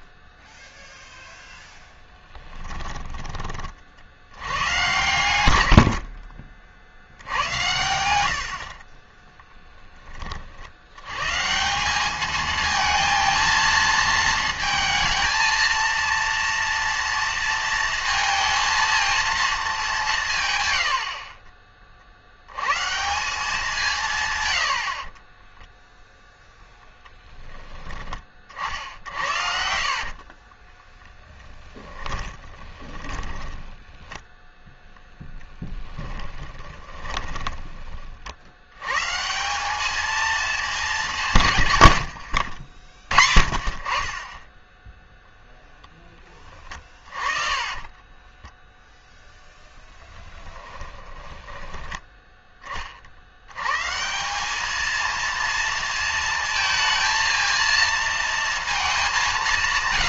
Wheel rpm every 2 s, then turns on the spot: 0, 20, 100, 60, 40, 90, 220, 220, 230, 230, 90, 130, 90, 10, 60, 20, 20, 0, 30, 110, 200, 70, 10, 30, 0, 20, 30, 230, 230, 210.
2-4 20-22 28-34 36-38 46-48 50-52